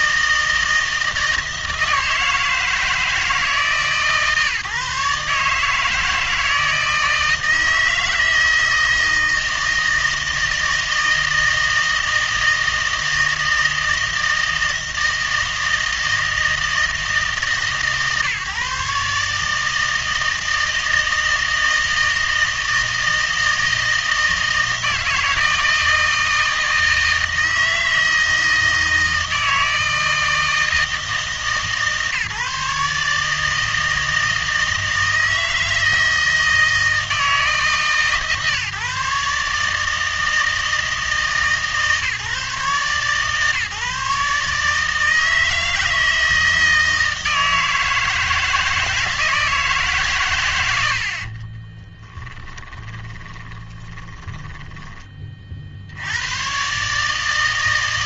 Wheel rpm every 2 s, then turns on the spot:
160, 160, 140, 160, 160, 160, 160, 160, 160, 140, 160, 160, 160, 160, 160, 160, 150, 160, 160, 140, 160, 150, 150, 160, 160, 100, 10, 10, 120.
52-56